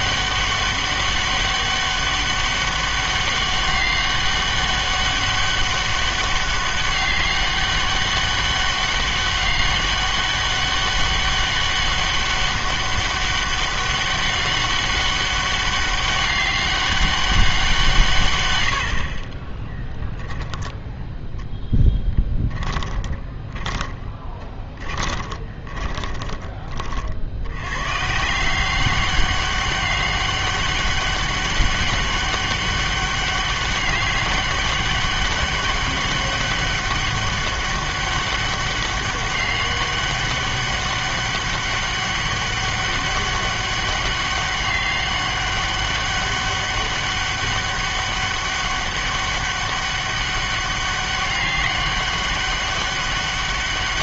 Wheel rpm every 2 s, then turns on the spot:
200, 200, 200, 200, 200, 200, 200, 200, 200, 110, 10, 10, 20, 30, 180, 200, 200, 200, 200, 200, 200, 200, 200, 200, 200, 200, 200.
22-26